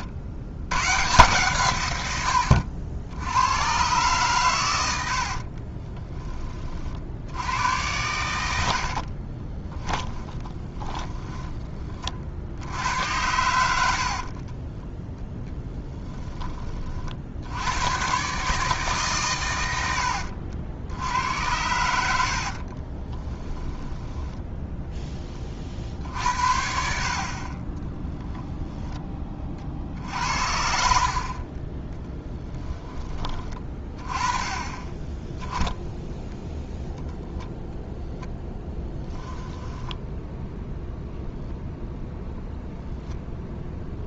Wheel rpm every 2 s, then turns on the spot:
120, 80, 80, 50, 60, 10, 90, 10, 40, 140, 80, 40, 10, 50, 10, 60, 20, 20, 0, 10, 0, 0.
4-6 8-12 14-16 22-24 34-36 38-40